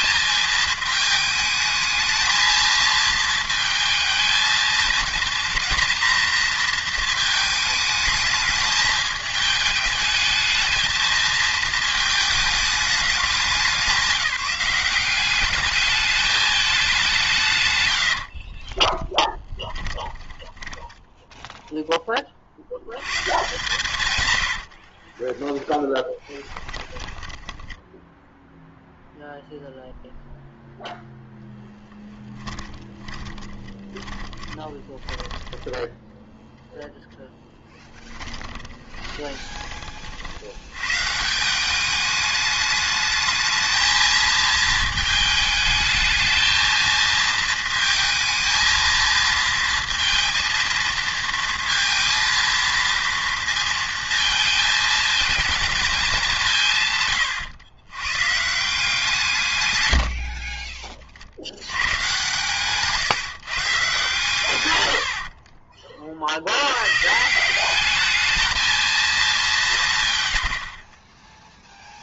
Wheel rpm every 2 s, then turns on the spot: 220, 220, 220, 230, 210, 220, 210, 180, 210, 30, 10, 90, 40, 10, 0, 0, 20, 20, 10, 30, 100, 210, 220, 230, 230, 230, 230, 220, 160, 150, 30, 140, 120, 90, 220, 60.
18-22 24-28 32-36 38-40 60-62